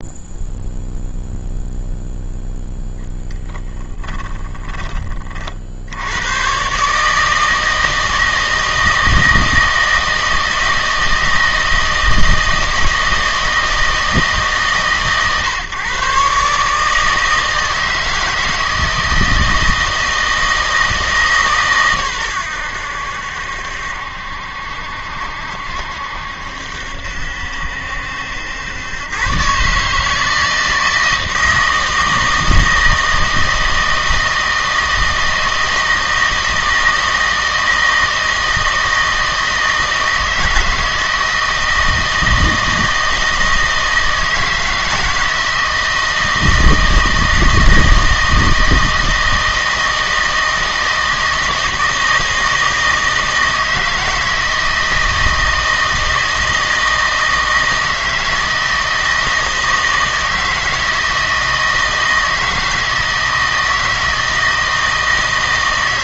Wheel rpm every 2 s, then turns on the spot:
0, 0, 20, 130, 160, 160, 160, 150, 150, 160, 160, 90, 70, 70, 100, 160, 160, 160, 160, 160, 160, 160, 160, 160, 160, 160, 160, 160, 160, 160, 160, 160, 160.
4-6